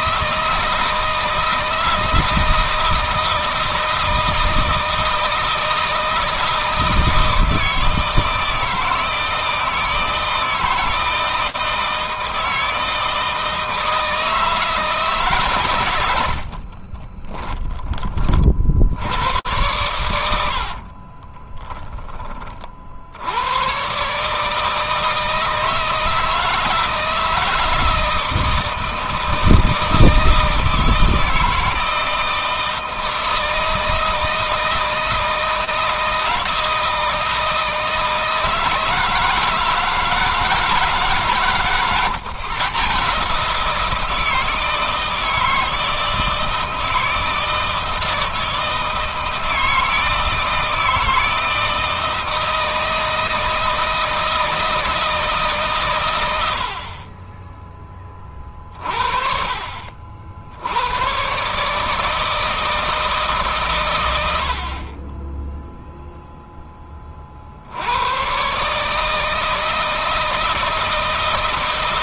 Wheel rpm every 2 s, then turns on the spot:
160, 160, 160, 160, 160, 160, 160, 160, 30, 80, 50, 70, 160, 160, 160, 160, 160, 160, 160, 160, 150, 150, 160, 160, 160, 160, 160, 160, 50, 40, 100, 150, 40, 20, 150, 160.
16-18 20-22